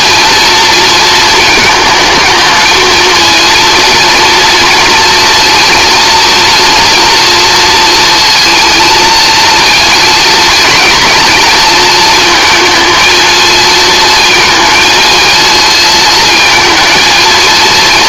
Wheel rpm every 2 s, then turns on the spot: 230, 220, 230, 230, 230, 230, 230, 220, 230.
none